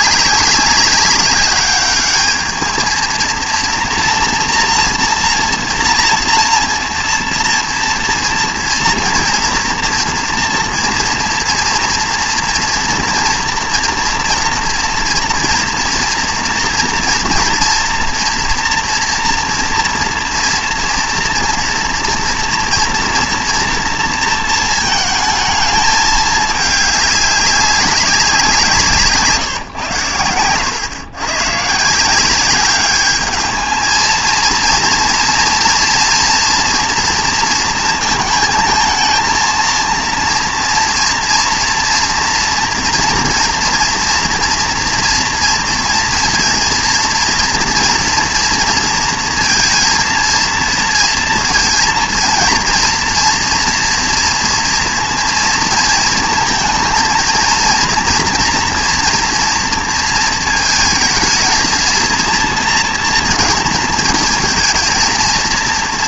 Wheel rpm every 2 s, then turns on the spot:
190, 220, 240, 230, 230, 240, 230, 240, 230, 230, 230, 230, 230, 210, 170, 100, 200, 230, 230, 230, 230, 230, 230, 230, 230, 230, 230, 230, 230, 230, 220, 230, 220.
none